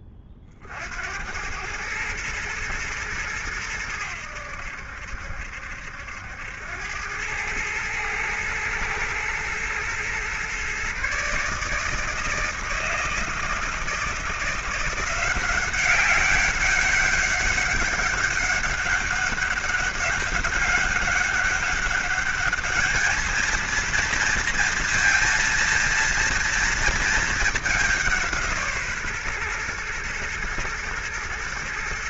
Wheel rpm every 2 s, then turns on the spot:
40, 110, 80, 90, 110, 130, 160, 170, 200, 200, 190, 210, 230, 230, 160, 120.
none